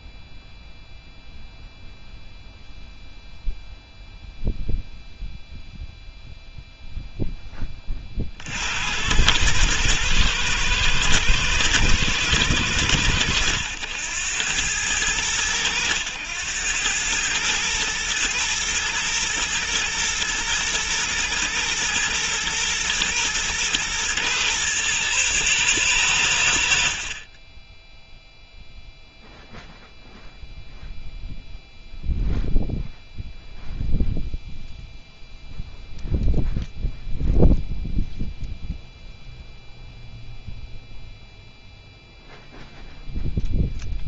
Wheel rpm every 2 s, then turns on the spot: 0, 0, 0, 0, 70, 110, 100, 100, 100, 110, 110, 110, 110, 80, 0, 0, 0, 0, 0, 0, 0, 0.
none